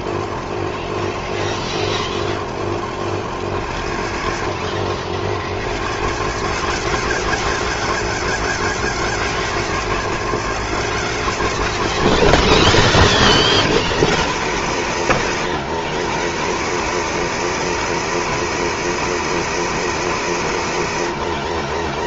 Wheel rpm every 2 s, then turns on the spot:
0, 0, 60, 120, 160, 160, 160, 150, 120, 160, 140.
none